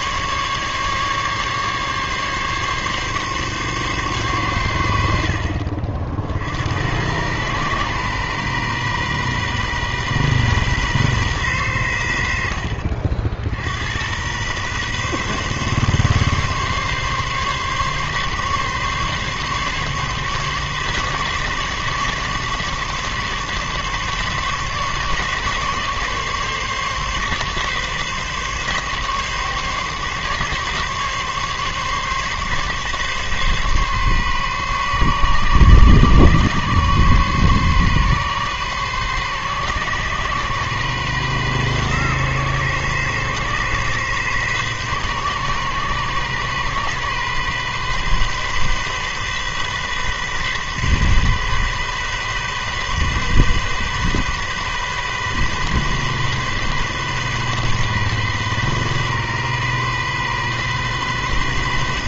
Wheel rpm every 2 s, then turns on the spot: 140, 140, 110, 70, 130, 130, 60, 120, 140, 140, 140, 140, 140, 140, 140, 140, 140, 140, 140, 140, 130, 130, 130, 130, 130, 130, 130, 130, 130, 130, 130.
none